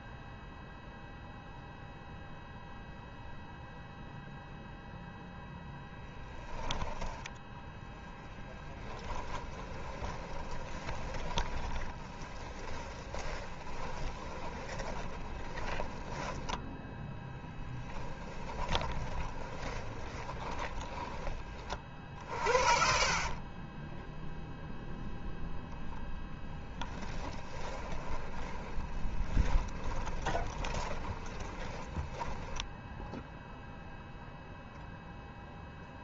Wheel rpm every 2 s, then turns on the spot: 0, 0, 0, 20, 30, 20, 20, 20, 10, 20, 20, 50, 0, 10, 20, 30, 10, 0.
8-22 26-34